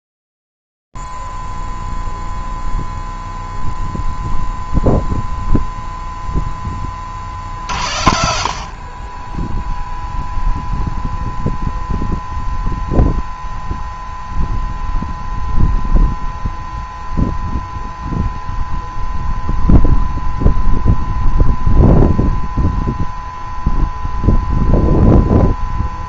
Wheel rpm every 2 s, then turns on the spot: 0, 0, 0, 0, 60, 0, 0, 0, 0, 0, 0, 0, 0.
none